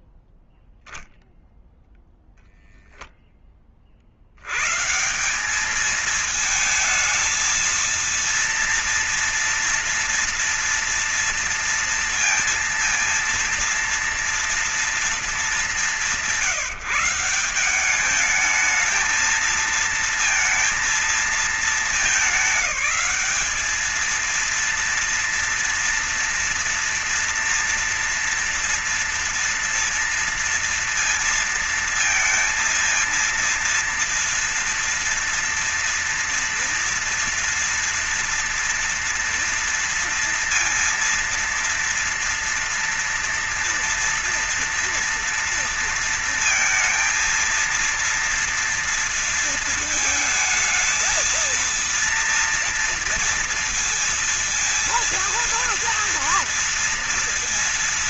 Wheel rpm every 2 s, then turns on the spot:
0, 0, 110, 220, 230, 230, 230, 230, 160, 220, 230, 210, 230, 230, 230, 230, 230, 230, 230, 230, 230, 230, 230, 230, 230, 220, 230, 230, 230.
none